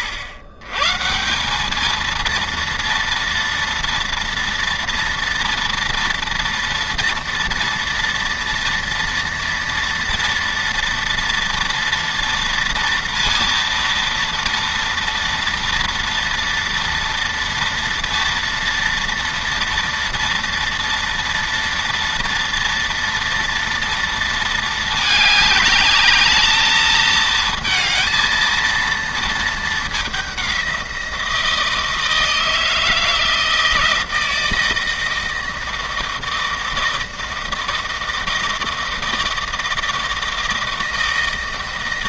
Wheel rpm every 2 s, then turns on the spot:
110, 230, 230, 230, 230, 230, 230, 230, 230, 230, 230, 230, 220, 220, 230, 180, 160, 160, 160, 160, 160.
none